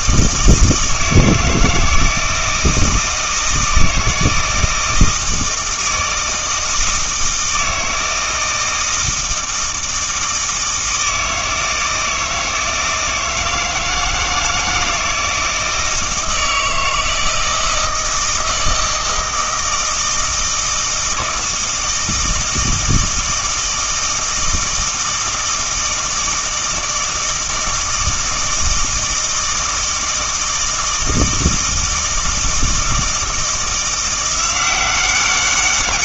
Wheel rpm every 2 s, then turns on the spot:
160, 160, 160, 160, 160, 160, 160, 160, 160, 160, 160, 160, 160, 160, 160, 160, 160, 180.
none